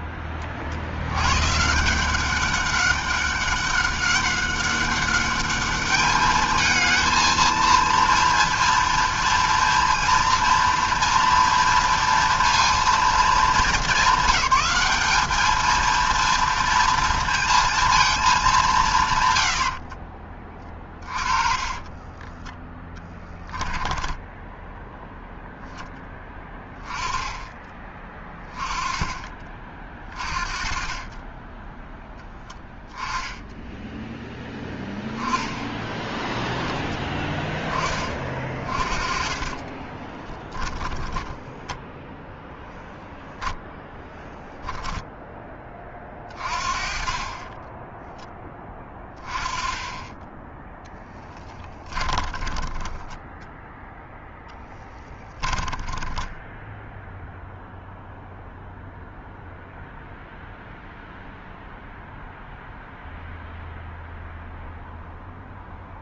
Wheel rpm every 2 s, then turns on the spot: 90, 200, 200, 220, 230, 230, 230, 210, 230, 140, 30, 10, 0, 20, 20, 30, 10, 10, 10, 30, 10, 0, 10, 30, 20, 10, 10, 20, 0, 0, 0, 0, 0.
20-24 38-42 50-52 54-56